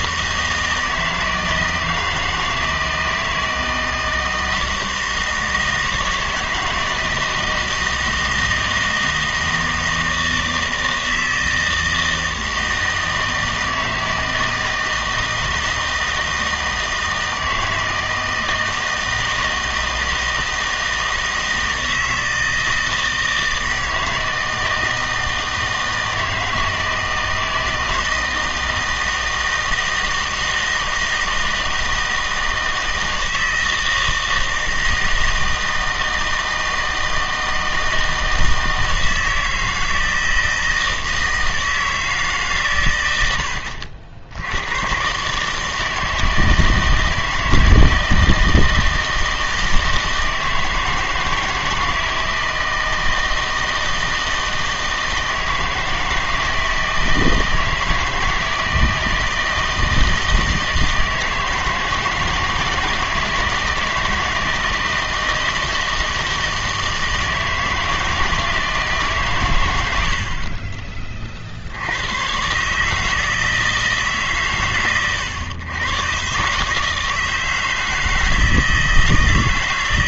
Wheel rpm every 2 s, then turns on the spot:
160, 160, 160, 160, 160, 160, 160, 160, 160, 160, 160, 160, 160, 160, 160, 160, 160, 160, 160, 160, 160, 130, 100, 160, 160, 160, 160, 160, 160, 160, 160, 160, 160, 160, 160, 30, 140, 130, 140, 160.
none